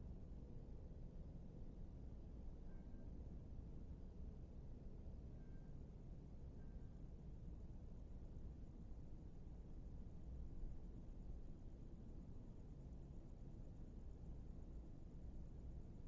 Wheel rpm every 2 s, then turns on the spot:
0, 0, 0, 0, 0, 0, 0, 0.
none